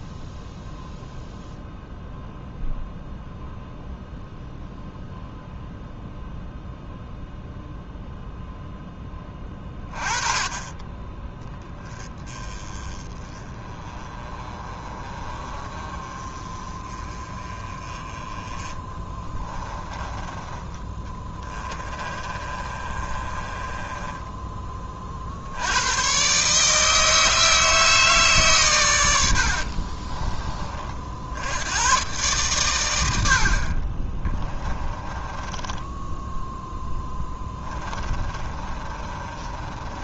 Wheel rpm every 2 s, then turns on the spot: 0, 0, 0, 0, 10, 20, 20, 30, 30, 20, 20, 30, 20, 140, 130, 30, 120, 20, 10, 30.
18-20 22-24 34-40